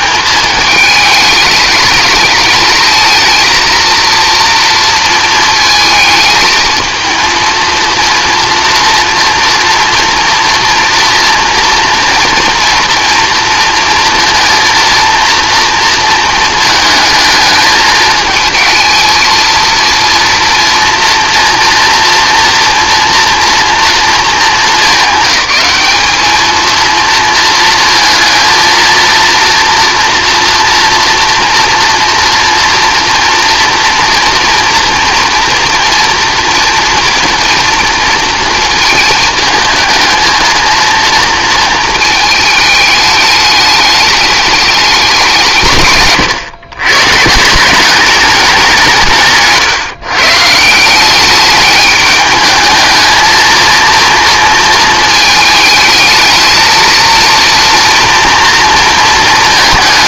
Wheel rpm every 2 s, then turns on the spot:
210, 220, 230, 220, 230, 240, 240, 230, 220, 220, 230, 230, 220, 220, 230, 230, 240, 230, 230, 220, 230, 210, 210, 120, 180, 170, 220, 220, 230, 230.
none